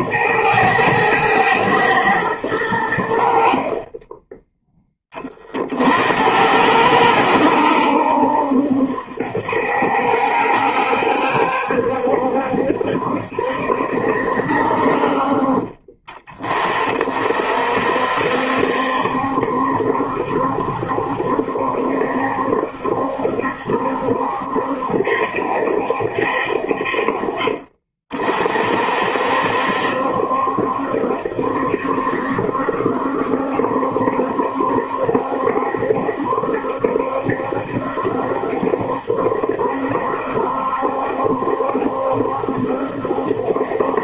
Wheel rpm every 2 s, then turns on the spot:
110, 90, 10, 90, 70, 70, 70, 60, 30, 70, 70, 70, 70, 50, 50, 70, 70, 70, 70, 70, 70, 70.
none